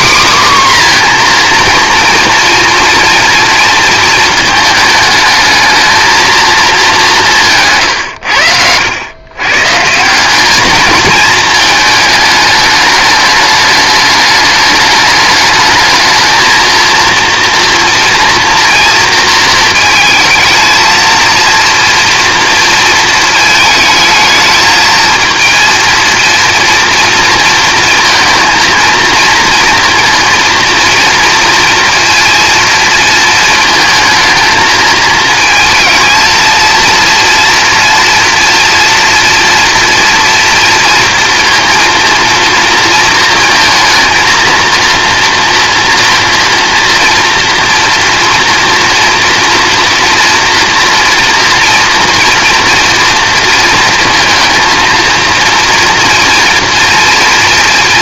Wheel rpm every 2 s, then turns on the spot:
270, 230, 220, 220, 90, 210, 210, 210, 230, 240, 220, 230, 220, 240, 230, 230, 230, 220, 230, 230, 230, 230, 230, 230, 230, 230, 230, 230, 230.
none